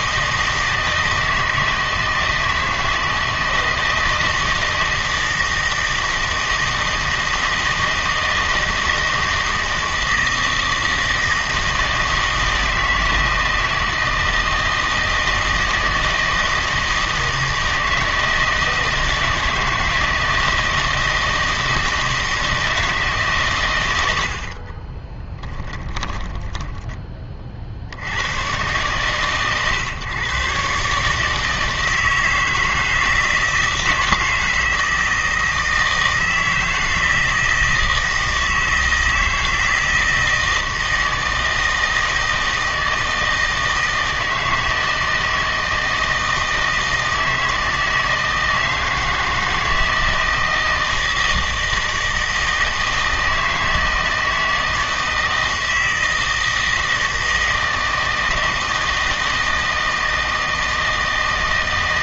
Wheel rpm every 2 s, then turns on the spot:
160, 160, 160, 160, 160, 160, 160, 160, 160, 160, 160, 160, 30, 20, 120, 140, 160, 160, 160, 160, 160, 160, 160, 160, 160, 160, 160, 160, 160, 160, 160.
24-28